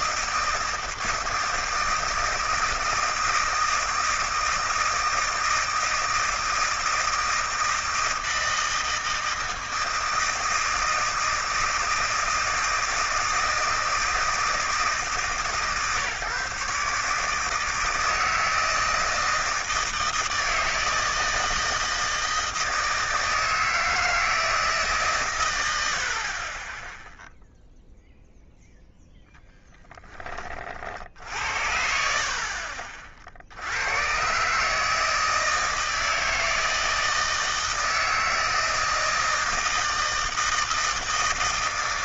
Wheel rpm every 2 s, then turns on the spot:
160, 160, 160, 160, 160, 160, 160, 160, 140, 160, 160, 160, 160, 30, 0, 30, 50, 140, 160, 160, 160.
none